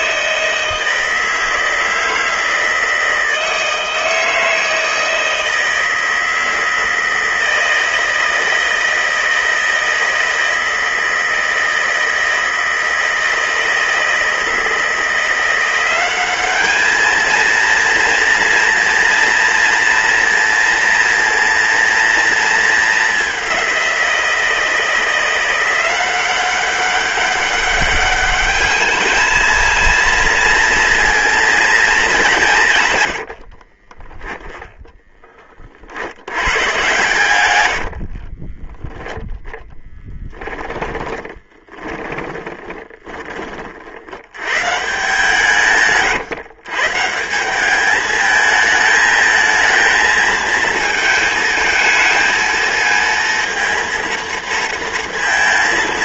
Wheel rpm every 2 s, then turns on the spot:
160, 160, 160, 160, 160, 160, 160, 160, 200, 230, 230, 220, 170, 190, 210, 230, 170, 10, 110, 20, 10, 20, 120, 130, 220, 220, 230, 230.
38-44